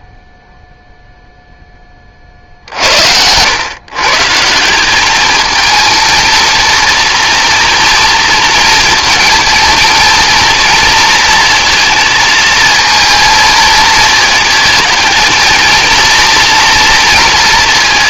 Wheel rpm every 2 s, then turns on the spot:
0, 60, 170, 230, 230, 230, 220, 220, 230.
none